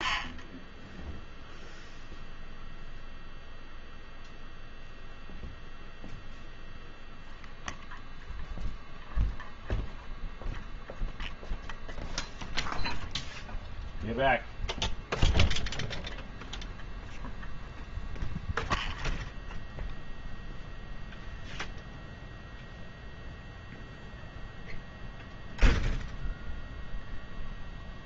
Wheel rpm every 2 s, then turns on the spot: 0, 0, 0, 0, 0, 0, 0, 0, 0, 0, 0, 0, 0, 0.
none